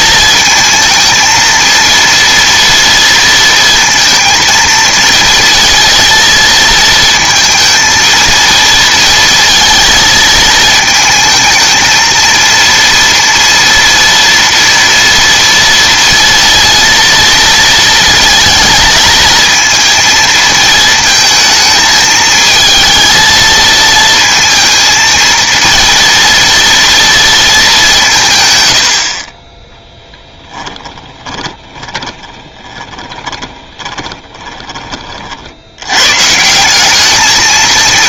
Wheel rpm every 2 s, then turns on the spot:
220, 230, 230, 220, 230, 220, 230, 230, 230, 220, 220, 220, 230, 230, 110, 10, 20, 20, 160.
30-34